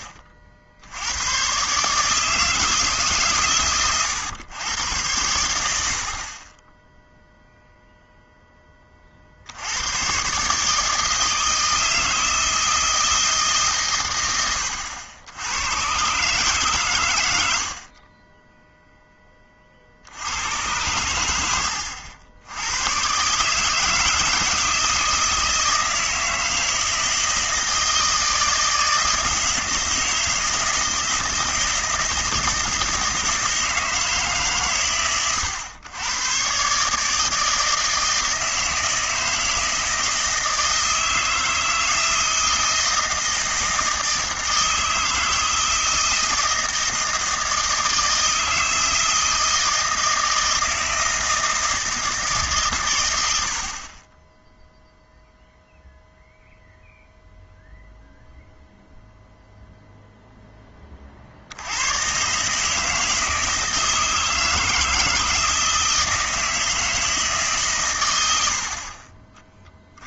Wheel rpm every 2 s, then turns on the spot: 60, 160, 110, 20, 10, 140, 160, 90, 130, 0, 100, 90, 160, 160, 160, 160, 160, 130, 130, 160, 160, 160, 160, 160, 160, 160, 130, 0, 0, 0, 10, 150, 160, 160, 70.
none